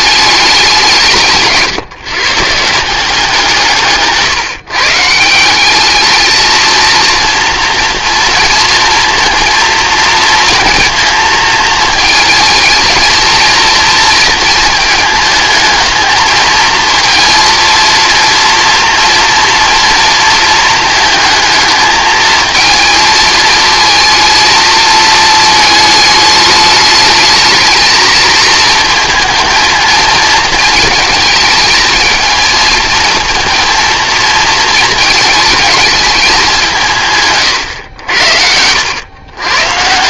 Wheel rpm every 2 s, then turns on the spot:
190, 170, 140, 230, 230, 220, 220, 220, 230, 230, 220, 220, 220, 210, 230, 220, 220, 220, 160, 80.
none